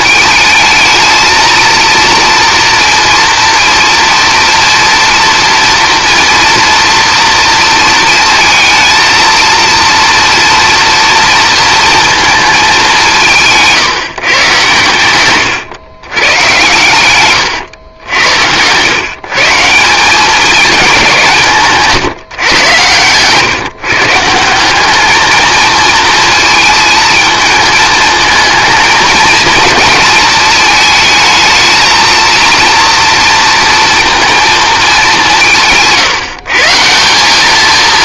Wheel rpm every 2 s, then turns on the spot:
220, 230, 230, 240, 230, 230, 210, 120, 110, 110, 210, 120, 190, 230, 230, 220, 230, 220, 160.
none